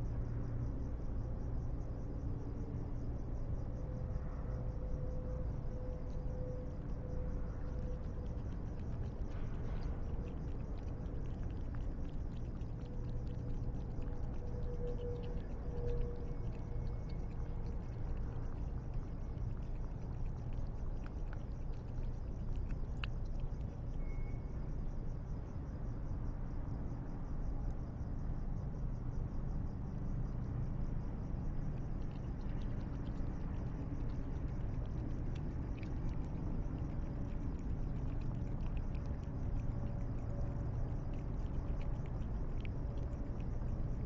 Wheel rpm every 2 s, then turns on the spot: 0, 0, 0, 0, 0, 0, 0, 0, 0, 0, 0, 0, 0, 0, 0, 0, 0, 0, 0, 0, 0, 0.
none